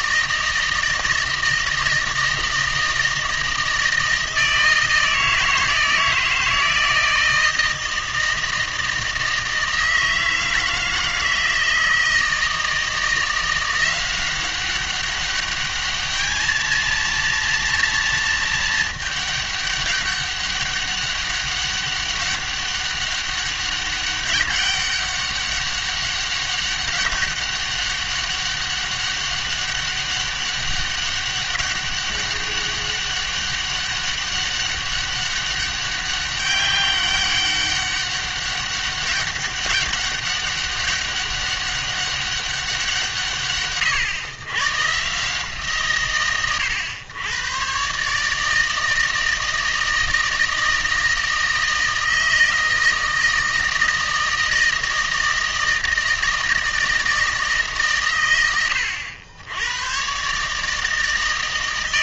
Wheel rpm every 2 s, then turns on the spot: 160, 160, 160, 160, 160, 160, 160, 190, 220, 220, 200, 200, 200, 200, 200, 200, 200, 200, 200, 200, 200, 180, 130, 110, 160, 160, 160, 160, 160, 90, 150.
none